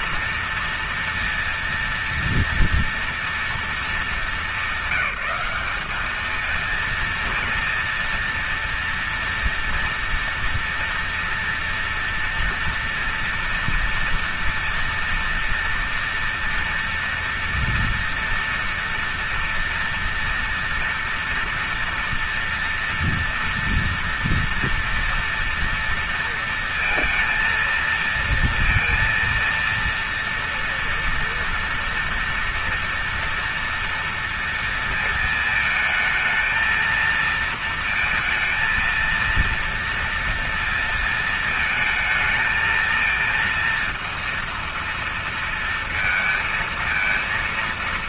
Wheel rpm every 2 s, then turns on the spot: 230, 230, 210, 210, 230, 230, 230, 230, 230, 230, 230, 240, 230, 230, 230, 230, 230, 230, 220, 230, 230, 220, 230, 230.
none